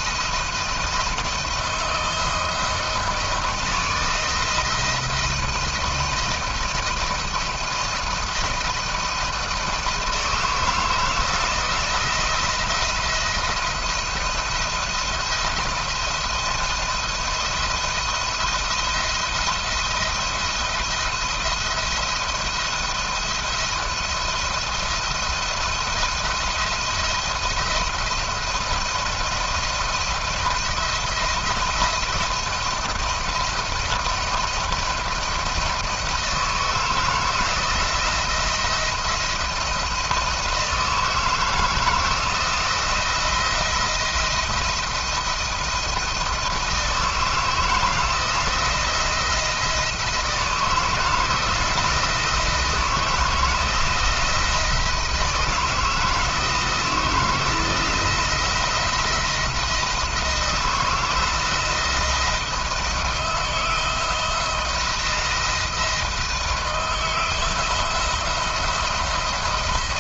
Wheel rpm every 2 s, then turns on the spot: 170, 160, 160, 160, 160, 160, 170, 170, 170, 170, 170, 170, 170, 170, 170, 170, 170, 170, 160, 170, 160, 160, 170, 160, 170, 170, 160, 160, 160, 170, 160, 160, 170, 170, 170.
none